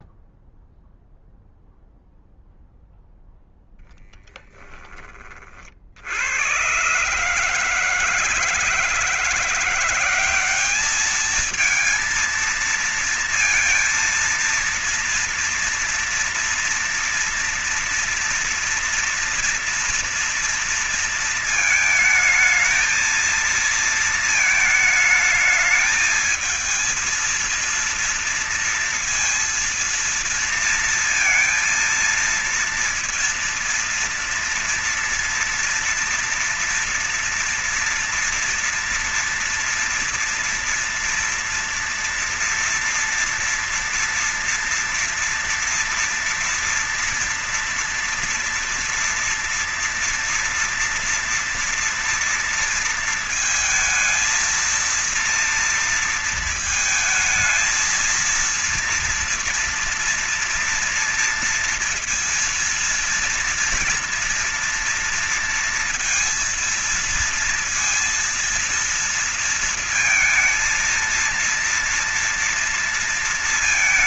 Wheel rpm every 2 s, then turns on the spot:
0, 0, 20, 110, 160, 200, 230, 230, 240, 230, 230, 220, 220, 220, 230, 230, 230, 230, 230, 230, 230, 230, 230, 230, 230, 240, 230, 230, 230, 230, 230, 230, 230, 230, 230, 230, 230.
none